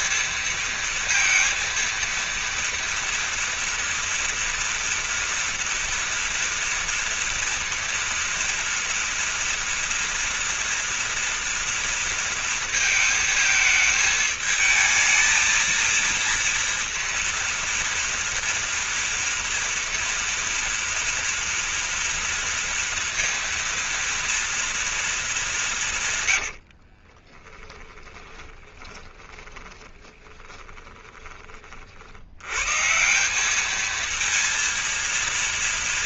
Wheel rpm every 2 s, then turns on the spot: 230, 230, 230, 240, 230, 230, 230, 220, 230, 230, 230, 230, 230, 60, 20, 20, 140, 230.
26-32